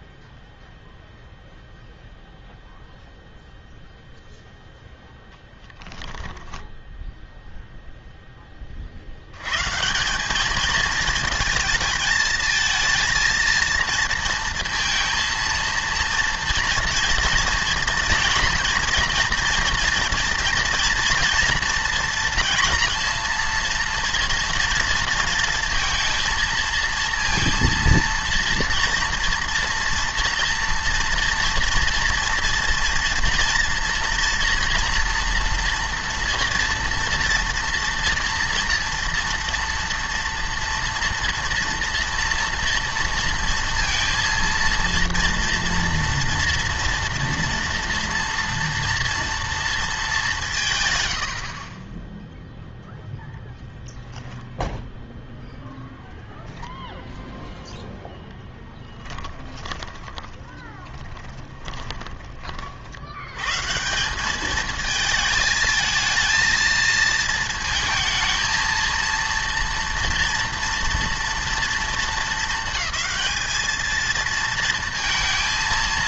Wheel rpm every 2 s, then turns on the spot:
0, 0, 0, 0, 90, 220, 230, 230, 230, 230, 240, 240, 230, 230, 230, 240, 230, 240, 240, 230, 230, 230, 230, 230, 230, 140, 0, 0, 10, 10, 20, 50, 220, 230, 220, 230, 220, 230.
58-62